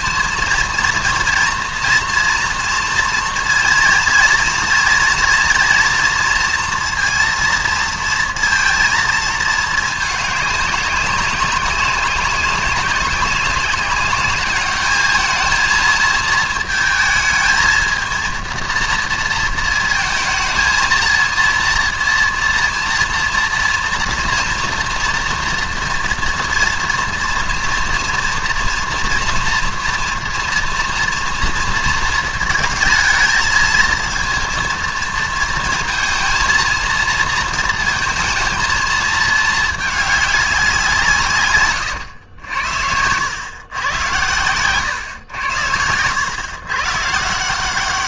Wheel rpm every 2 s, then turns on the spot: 230, 230, 230, 230, 230, 210, 200, 200, 220, 220, 230, 230, 230, 240, 230, 240, 230, 230, 230, 230, 210, 100, 110, 110.
none